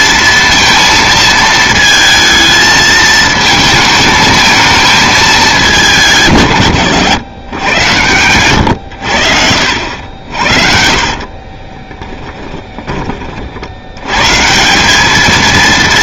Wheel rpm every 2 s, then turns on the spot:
230, 220, 220, 120, 90, 50, 30, 200.
10-14